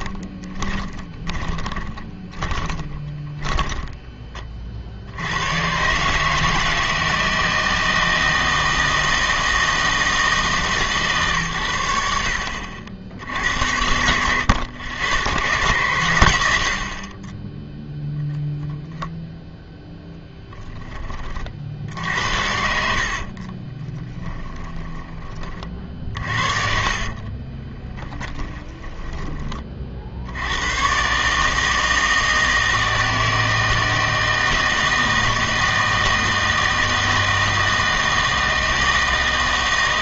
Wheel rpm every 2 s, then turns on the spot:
20, 30, 50, 160, 160, 140, 70, 80, 80, 0, 10, 60, 20, 40, 10, 100, 160, 160, 160, 160.
0-4 22-30